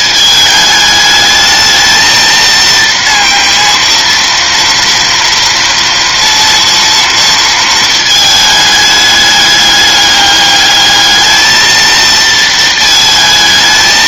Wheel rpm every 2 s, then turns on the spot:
220, 230, 230, 240, 210, 210, 220.
none